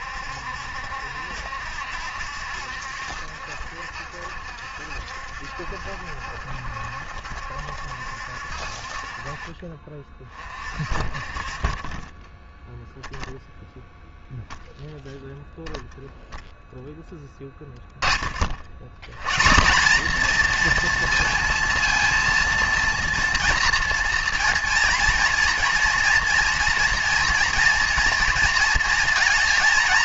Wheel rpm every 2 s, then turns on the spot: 70, 70, 60, 70, 50, 40, 10, 0, 0, 80, 240, 230, 240, 240, 230.
none